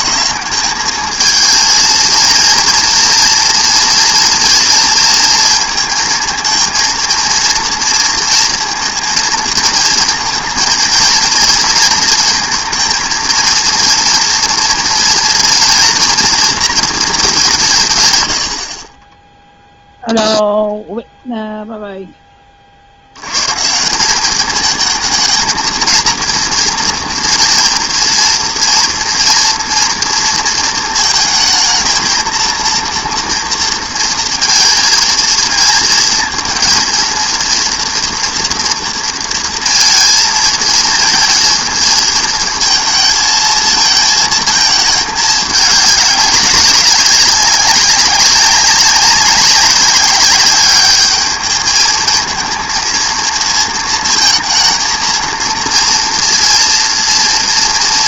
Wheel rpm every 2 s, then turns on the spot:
210, 230, 230, 230, 230, 230, 230, 230, 230, 60, 0, 40, 220, 240, 230, 230, 230, 230, 230, 230, 230, 220, 220, 190, 200, 200, 230, 220, 230.
none